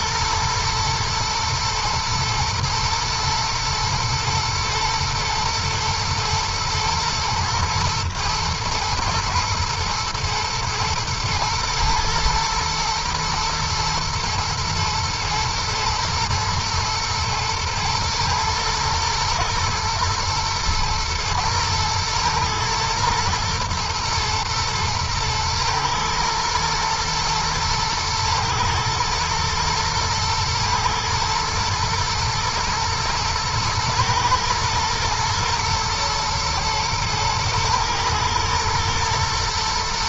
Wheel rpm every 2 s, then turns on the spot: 120, 110, 110, 120, 120, 110, 110, 110, 110, 120, 110, 110, 120, 120, 110, 110, 110, 110, 110, 110.
none